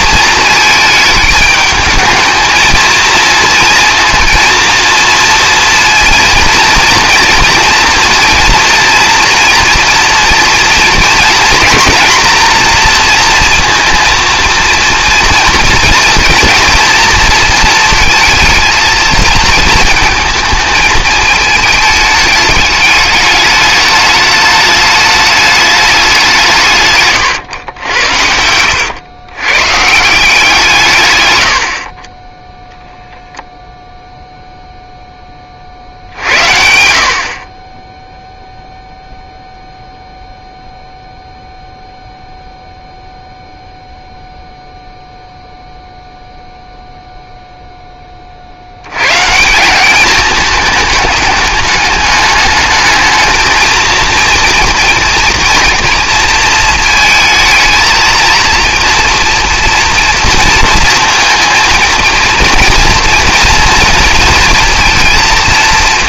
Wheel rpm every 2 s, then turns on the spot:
220, 230, 230, 230, 230, 240, 230, 230, 230, 220, 220, 210, 210, 150, 100, 160, 0, 0, 70, 0, 0, 0, 0, 0, 70, 210, 210, 230, 220, 230, 230, 230, 230.
none